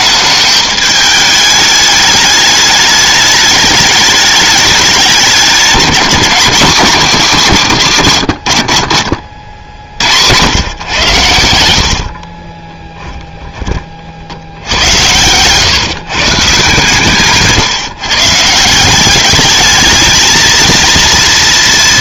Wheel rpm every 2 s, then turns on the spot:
210, 210, 210, 210, 90, 110, 20, 80, 140, 160, 230.
8-10 12-14